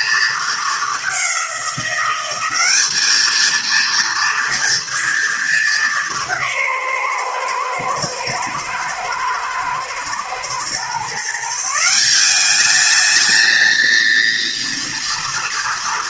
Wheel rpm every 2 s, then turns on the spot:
220, 200, 230, 160, 110, 120, 210, 230.
none